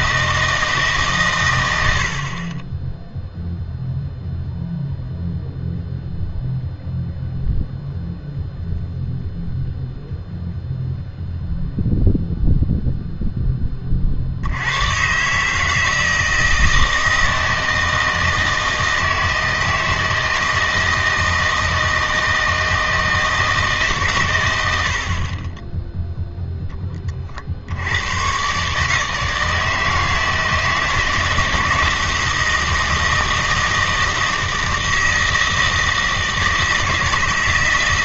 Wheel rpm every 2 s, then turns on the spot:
160, 20, 0, 0, 0, 0, 0, 100, 160, 160, 160, 160, 90, 10, 140, 160, 160, 160, 160.
none